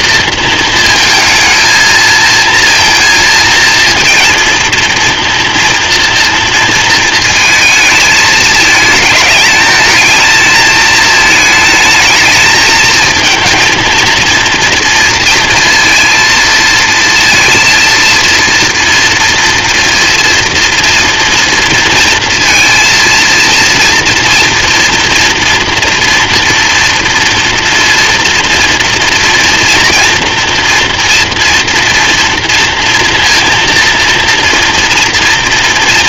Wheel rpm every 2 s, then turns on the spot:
220, 230, 230, 230, 220, 220, 220, 230, 230, 230, 230, 230, 240, 230, 230, 230, 230, 230.
none